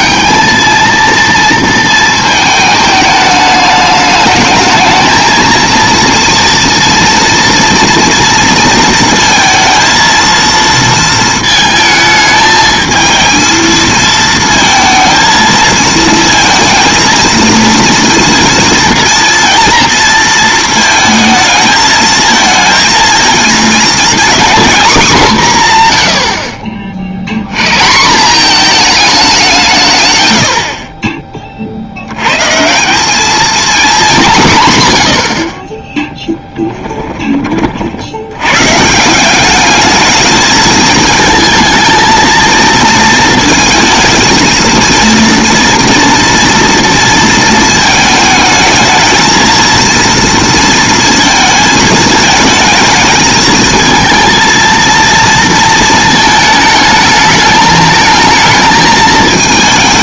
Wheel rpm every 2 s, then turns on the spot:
210, 220, 220, 240, 230, 230, 220, 230, 230, 230, 220, 220, 240, 40, 210, 80, 150, 140, 10, 120, 220, 230, 230, 230, 220, 230, 220, 230, 220, 220.
36-38